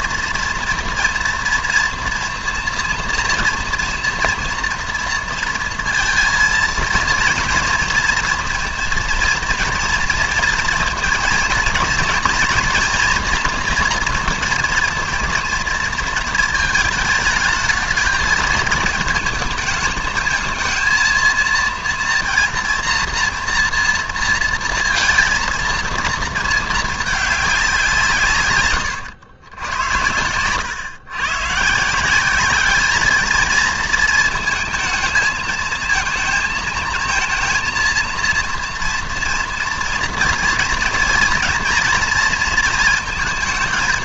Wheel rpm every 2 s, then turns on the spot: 230, 230, 240, 230, 230, 220, 230, 230, 220, 220, 220, 230, 230, 220, 120, 110, 210, 220, 220, 230, 230, 220.
none